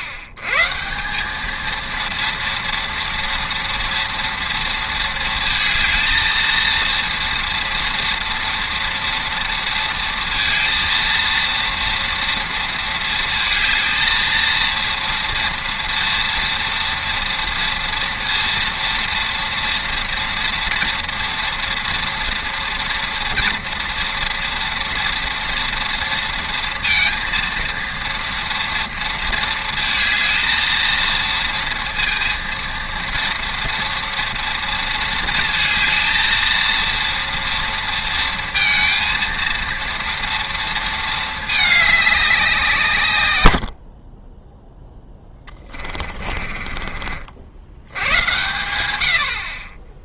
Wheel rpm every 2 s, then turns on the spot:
110, 230, 230, 230, 230, 230, 230, 230, 240, 230, 230, 230, 240, 230, 230, 230, 230, 230, 230, 230, 230, 160, 10, 40, 90.
46-48